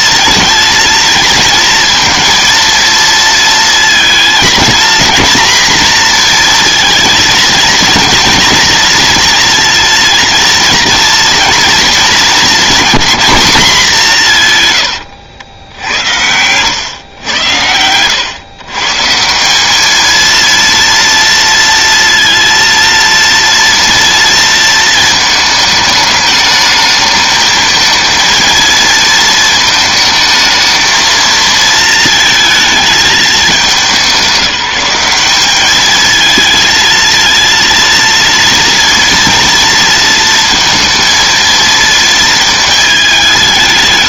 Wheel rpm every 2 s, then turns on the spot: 230, 230, 240, 230, 230, 230, 220, 110, 110, 150, 230, 230, 230, 220, 230, 220, 220, 190, 230, 230, 230, 220.
14-16